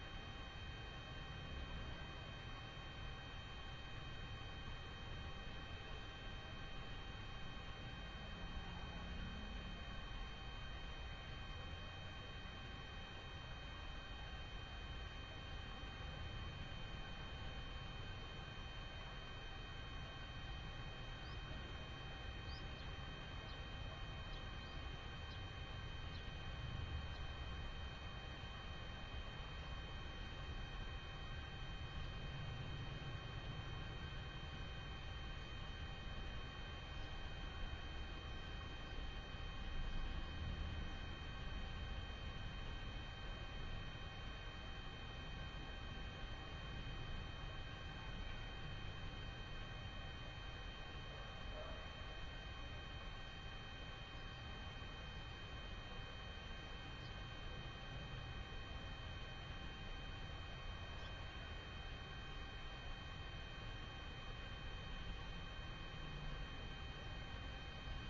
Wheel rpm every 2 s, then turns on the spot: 0, 0, 0, 0, 0, 0, 0, 0, 0, 0, 0, 0, 0, 0, 0, 0, 0, 0, 0, 0, 0, 0, 0, 0, 0, 0, 0, 0, 0, 0, 0, 0, 0, 0.
none